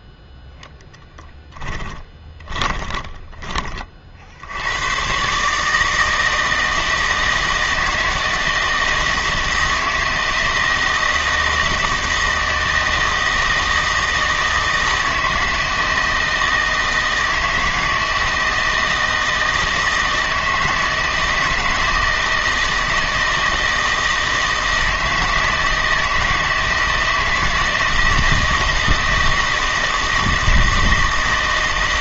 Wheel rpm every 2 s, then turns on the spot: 0, 20, 90, 160, 160, 160, 160, 160, 160, 160, 160, 160, 160, 160, 160, 160.
2-4